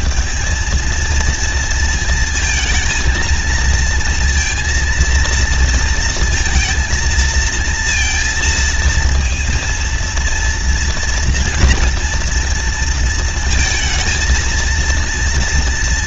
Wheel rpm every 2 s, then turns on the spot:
220, 220, 230, 230, 230, 230, 230, 230.
none